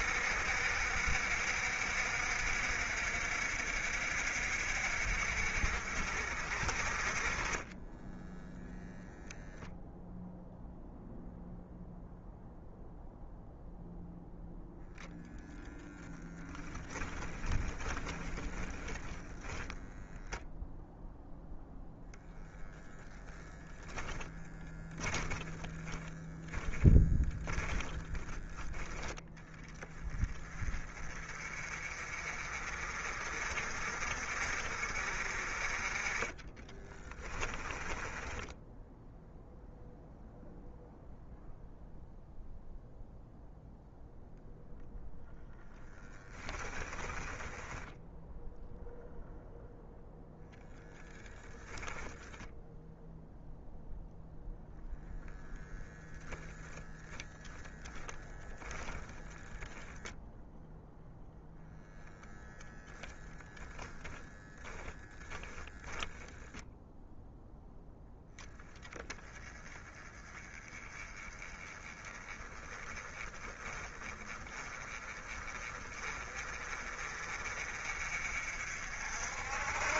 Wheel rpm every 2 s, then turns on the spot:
60, 60, 60, 40, 0, 0, 0, 0, 10, 10, 0, 0, 10, 10, 10, 30, 40, 40, 20, 0, 0, 0, 0, 20, 0, 0, 0, 0, 0, 0, 0, 0, 10, 0, 10, 20, 20, 30, 40, 60.
16-20 24-26 36-38 46-48 64-66